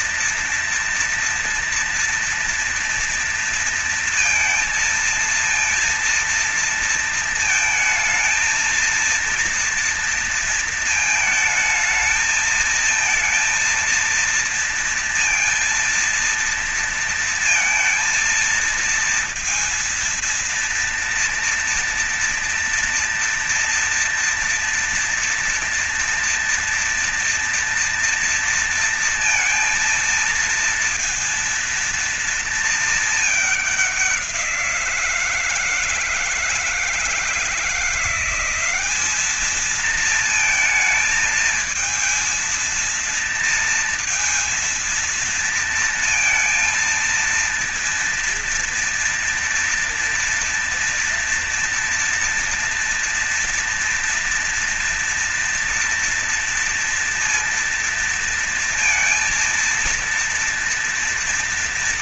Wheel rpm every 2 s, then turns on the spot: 240, 230, 230, 230, 220, 230, 220, 230, 230, 230, 230, 230, 230, 230, 230, 230, 220, 170, 160, 200, 220, 230, 230, 230, 230, 230, 230, 230, 230, 230, 230.
none